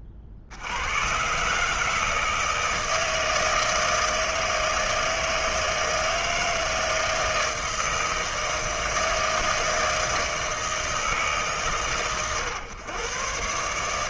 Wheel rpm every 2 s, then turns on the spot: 60, 160, 160, 160, 160, 160, 120.
none